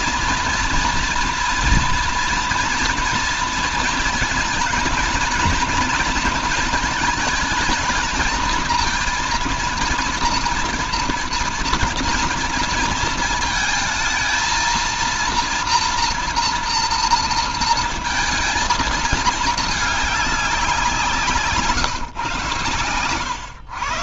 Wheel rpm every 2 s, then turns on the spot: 230, 230, 230, 220, 220, 230, 230, 230, 230, 230, 190, 120.
none